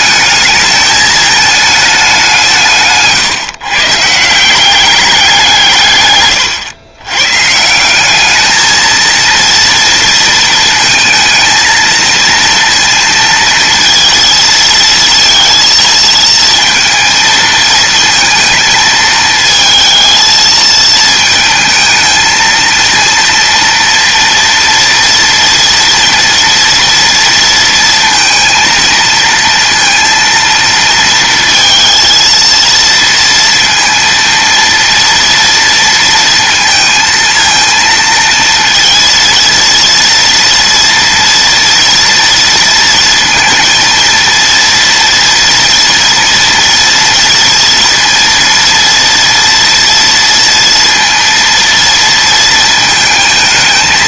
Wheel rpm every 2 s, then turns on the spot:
220, 160, 190, 100, 220, 230, 230, 230, 230, 220, 220, 230, 240, 230, 230, 230, 230, 230, 230, 230, 230, 230, 240, 230, 230, 230, 230.
none